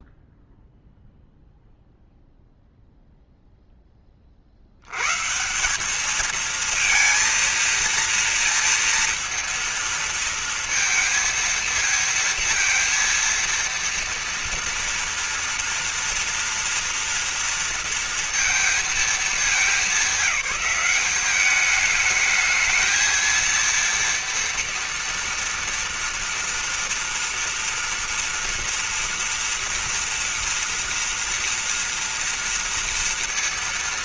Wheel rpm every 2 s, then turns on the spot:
0, 0, 60, 220, 230, 230, 230, 230, 230, 230, 210, 220, 230, 230, 240, 230, 230.
none